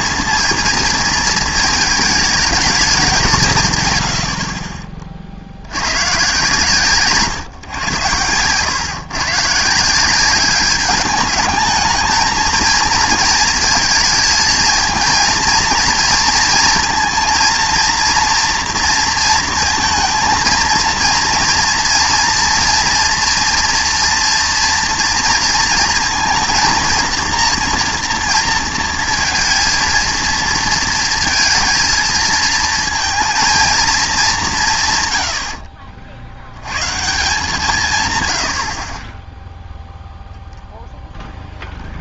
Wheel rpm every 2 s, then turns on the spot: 230, 220, 60, 130, 110, 200, 230, 230, 230, 230, 230, 230, 230, 230, 230, 230, 220, 170, 90, 90, 10.
none